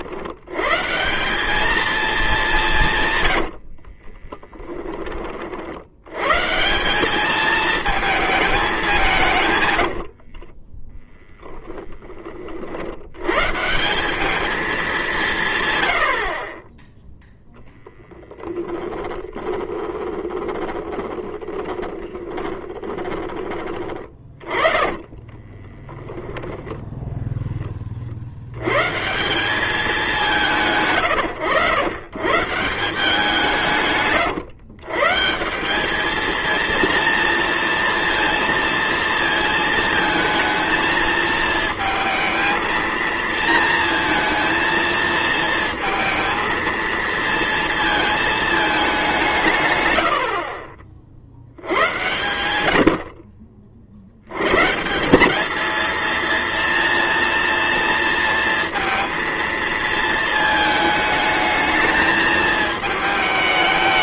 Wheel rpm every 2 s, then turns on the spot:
110, 190, 20, 150, 210, 50, 40, 210, 30, 10, 20, 20, 30, 10, 90, 130, 150, 150, 230, 230, 230, 230, 230, 230, 220, 50, 80, 130, 240, 230, 220, 220.
4-6 10-12 18-26